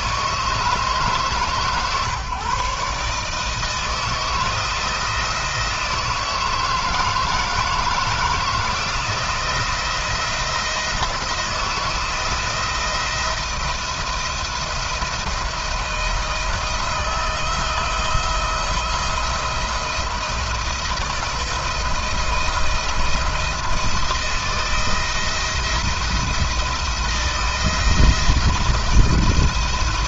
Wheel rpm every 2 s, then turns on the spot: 150, 140, 160, 160, 170, 170, 170, 170, 160, 170, 160, 170, 170, 170, 170.
none